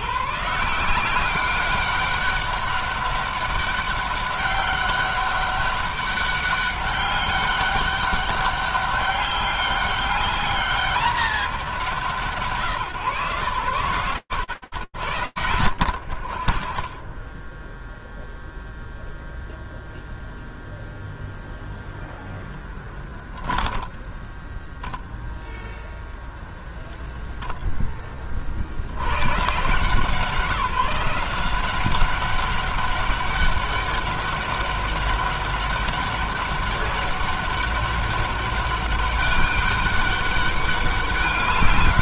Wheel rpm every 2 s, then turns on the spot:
150, 200, 200, 200, 200, 200, 130, 80, 20, 0, 0, 10, 0, 0, 140, 180, 200, 200, 200, 200, 200.
22-24